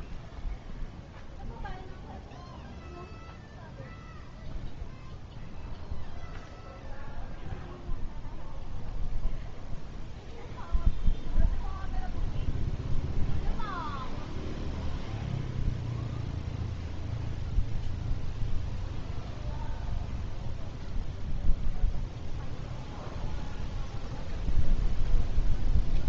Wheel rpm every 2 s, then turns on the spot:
0, 0, 0, 0, 0, 0, 0, 0, 0, 0, 0, 0, 0.
none